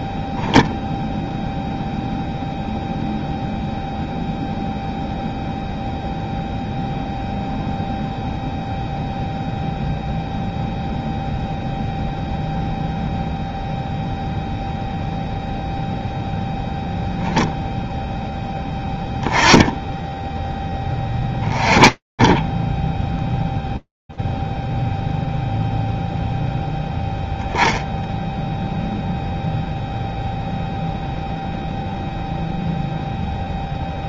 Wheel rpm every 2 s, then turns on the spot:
0, 0, 0, 0, 0, 0, 0, 0, 0, 10, 10, 0, 0, 10, 0, 0, 0.
18-20